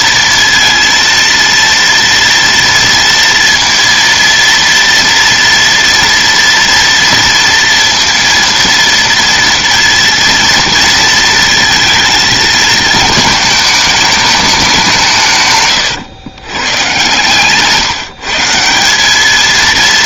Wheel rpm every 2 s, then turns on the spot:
230, 230, 230, 230, 230, 230, 220, 190, 120, 190.
none